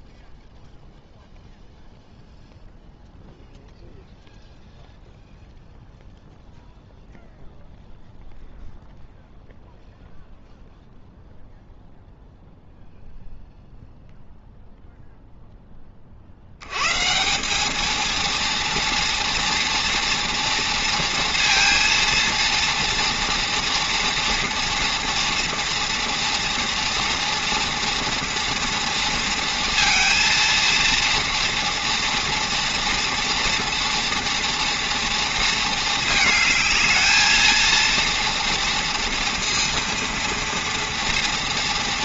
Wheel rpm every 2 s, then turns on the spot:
0, 0, 0, 0, 0, 0, 0, 0, 100, 230, 230, 230, 230, 230, 230, 230, 230, 230, 220, 230, 230.
none